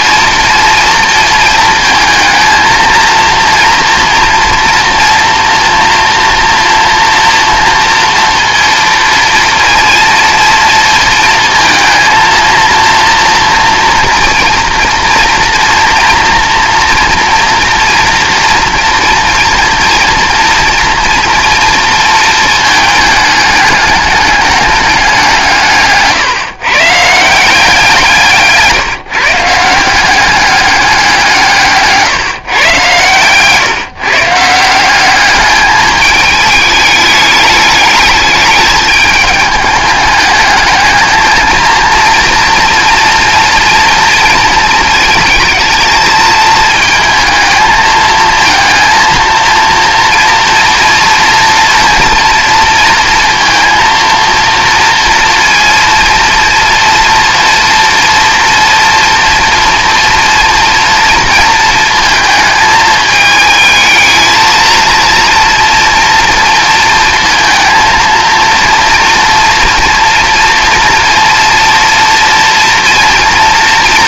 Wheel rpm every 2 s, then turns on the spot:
230, 220, 230, 230, 230, 230, 230, 230, 230, 240, 230, 220, 210, 140, 150, 200, 140, 170, 210, 210, 220, 230, 230, 220, 230, 230, 230, 230, 240, 230, 230, 220, 230, 230, 230, 230, 230.
none